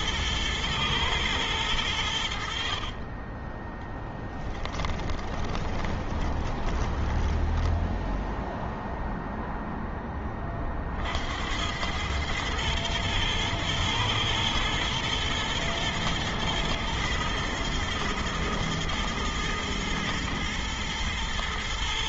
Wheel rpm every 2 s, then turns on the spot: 110, 80, 10, 20, 0, 20, 100, 110, 120, 120, 110.
4-8